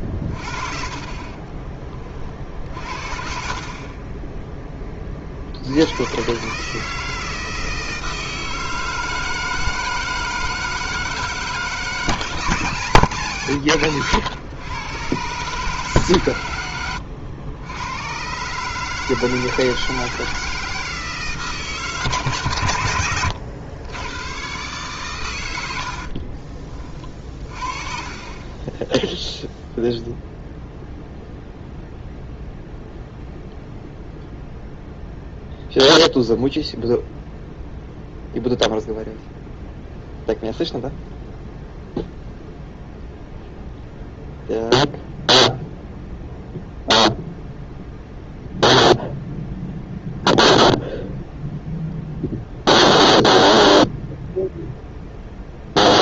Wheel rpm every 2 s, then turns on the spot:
50, 50, 10, 140, 160, 160, 160, 130, 110, 140, 160, 120, 120, 30, 20, 0, 0, 0, 0, 0, 0, 0, 0, 0, 0, 0, 0, 0.
28-30